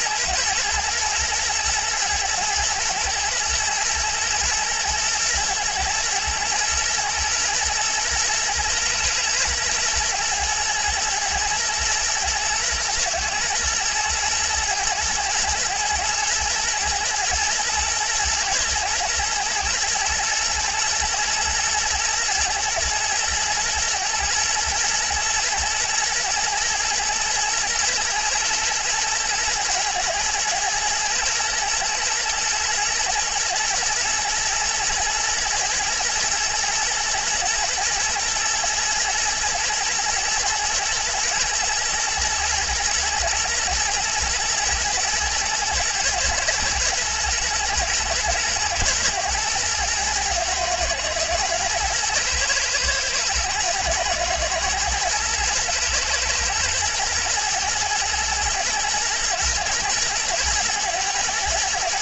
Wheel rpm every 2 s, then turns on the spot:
120, 110, 120, 120, 120, 110, 110, 110, 120, 110, 120, 110, 120, 110, 120, 110, 110, 120, 120, 110, 120, 110, 110, 120, 120, 110, 110, 110, 110, 110, 110.
none